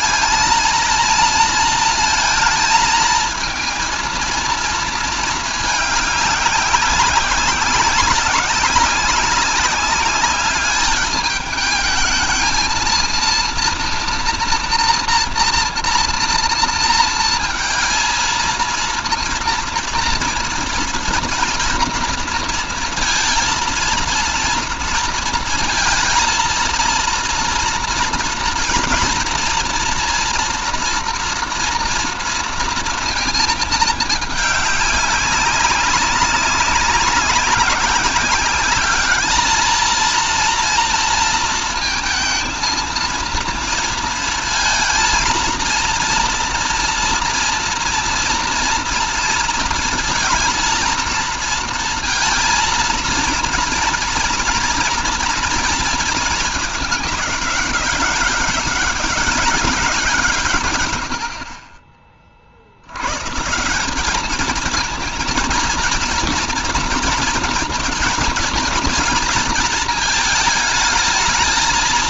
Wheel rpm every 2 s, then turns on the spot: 230, 220, 220, 190, 190, 200, 220, 230, 230, 230, 230, 230, 230, 230, 230, 230, 230, 200, 190, 210, 230, 230, 230, 230, 230, 230, 230, 230, 210, 190, 120, 60, 220, 230, 230, 220.
none